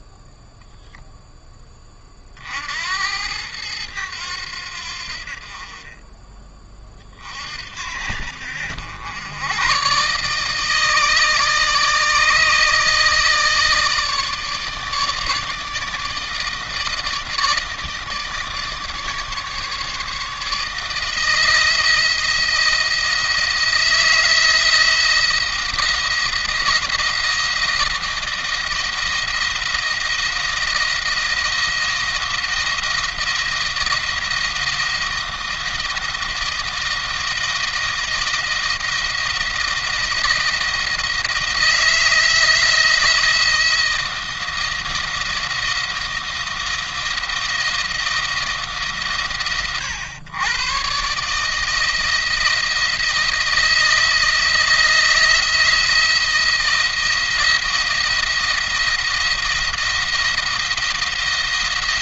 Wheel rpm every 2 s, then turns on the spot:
0, 60, 80, 30, 80, 150, 160, 160, 160, 150, 160, 170, 170, 170, 170, 170, 170, 170, 170, 170, 170, 170, 170, 170, 150, 120, 160, 160, 170, 170, 170.
none